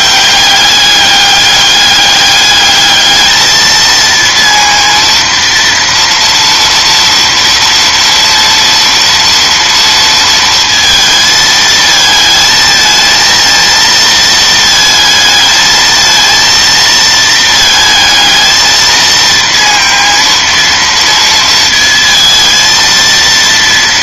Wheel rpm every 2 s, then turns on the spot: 200, 210, 230, 230, 230, 230, 220, 220, 230, 220, 230, 230.
none